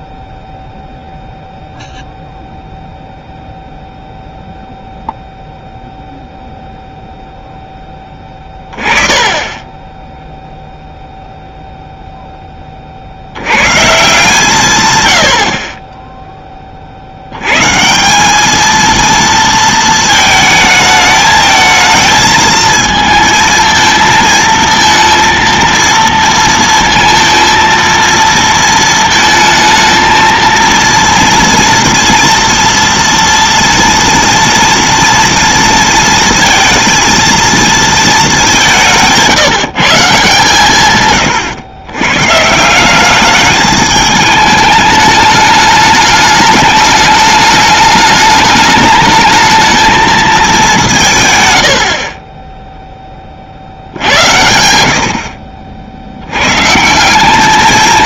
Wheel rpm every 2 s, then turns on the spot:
0, 0, 0, 20, 0, 20, 140, 10, 220, 220, 220, 230, 230, 230, 230, 230, 230, 230, 190, 150, 150, 210, 210, 210, 200, 10, 80, 100, 220.
6-8 50-52